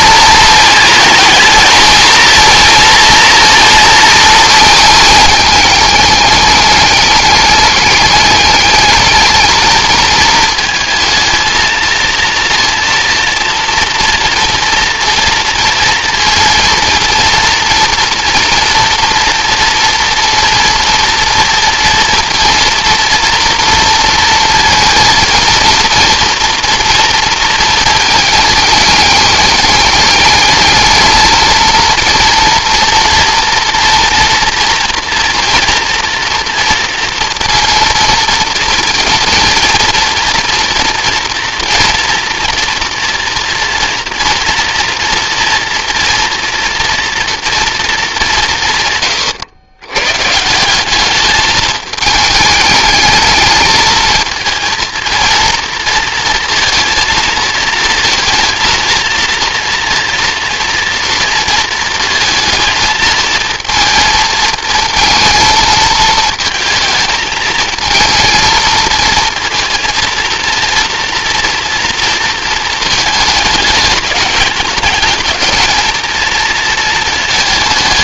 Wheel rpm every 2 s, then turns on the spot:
220, 230, 220, 210, 210, 220, 230, 230, 230, 230, 230, 230, 230, 230, 210, 220, 230, 230, 230, 230, 230, 230, 230, 230, 140, 190, 210, 230, 230, 230, 230, 220, 220, 220, 220, 240, 230, 210, 230.
none